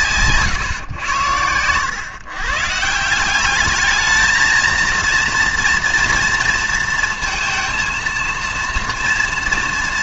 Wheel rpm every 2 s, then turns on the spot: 120, 140, 230, 230, 230.
none